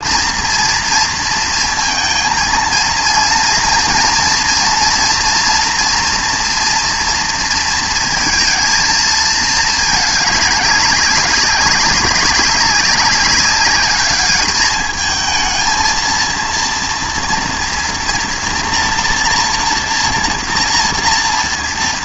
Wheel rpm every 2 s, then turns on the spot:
230, 230, 240, 230, 230, 200, 190, 210, 230, 230, 230.
none